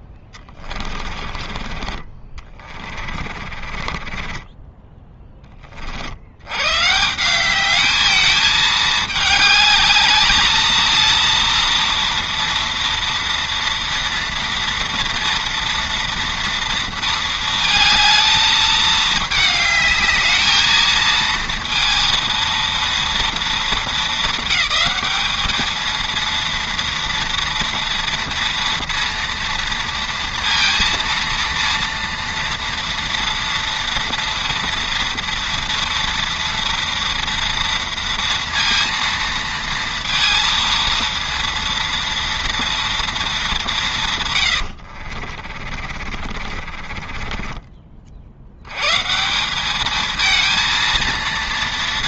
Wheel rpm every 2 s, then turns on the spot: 20, 30, 20, 120, 220, 230, 230, 230, 230, 220, 220, 230, 220, 230, 230, 230, 230, 230, 230, 230, 230, 230, 90, 40, 110, 220.
0-6 44-48